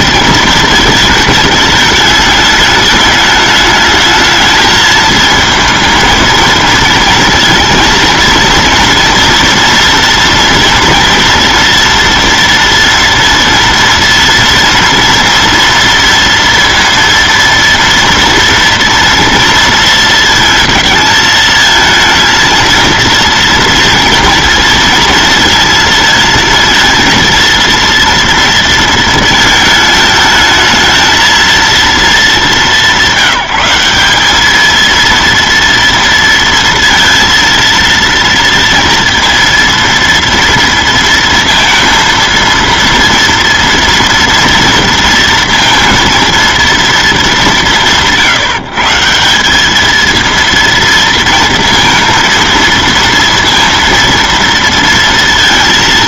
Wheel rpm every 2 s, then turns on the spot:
220, 210, 220, 220, 230, 230, 240, 230, 230, 230, 220, 230, 230, 230, 230, 220, 200, 210, 230, 230, 230, 230, 230, 230, 160, 230, 230, 230.
none